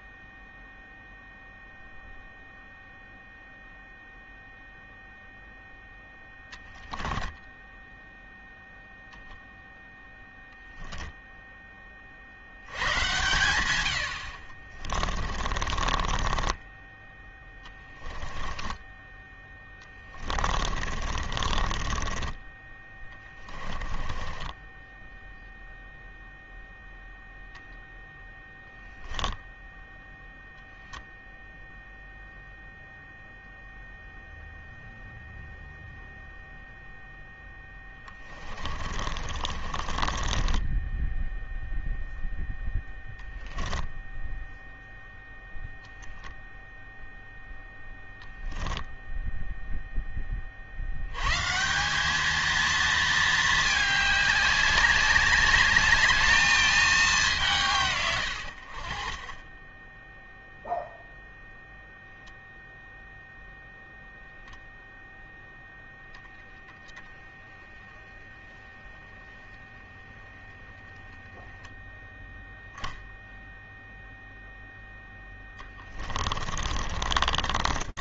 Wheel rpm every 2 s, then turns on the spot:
0, 0, 0, 10, 0, 0, 70, 60, 10, 20, 30, 20, 20, 0, 0, 0, 0, 0, 0, 40, 10, 10, 0, 0, 0, 80, 220, 190, 200, 40, 0, 0, 0, 0, 20, 10, 0, 0, 50.
6-8 16-26 38-44 76-78